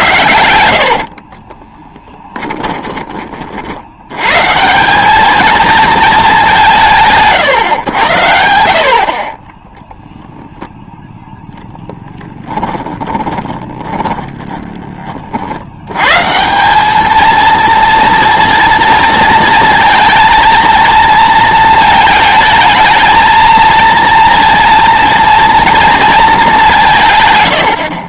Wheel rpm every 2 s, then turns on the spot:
70, 20, 170, 180, 80, 0, 10, 20, 180, 230, 230, 220, 230, 190.
0-4 12-14